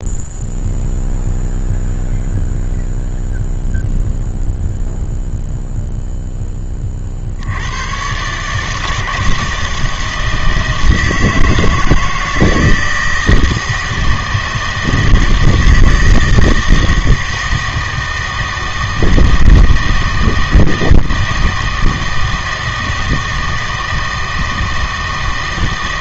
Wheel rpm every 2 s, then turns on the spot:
0, 0, 0, 10, 150, 160, 160, 160, 160, 160, 160, 160, 160.
none